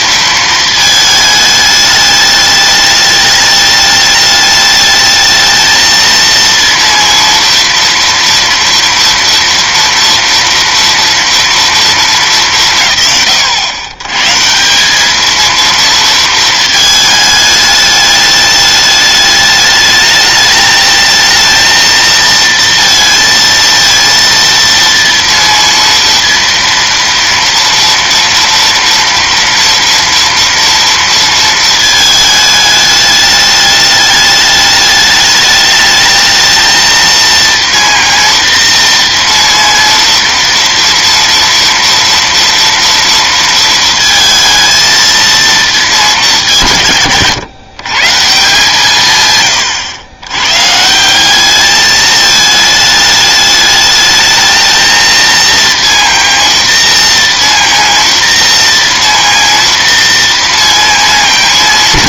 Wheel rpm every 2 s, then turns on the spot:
220, 210, 210, 230, 230, 230, 190, 160, 220, 210, 210, 230, 230, 230, 230, 230, 210, 210, 220, 230, 230, 230, 220, 180, 150, 120, 220, 220, 230, 230, 230.
none